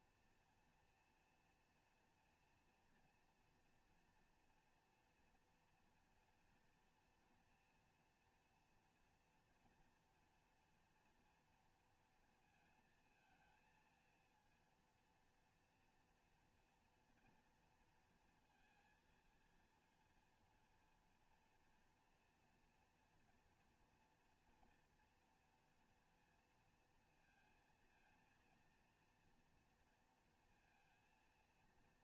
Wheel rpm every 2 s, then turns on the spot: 230, 230, 230, 230, 240, 230, 230, 230, 230, 230, 230, 240, 230, 230, 230, 230.
none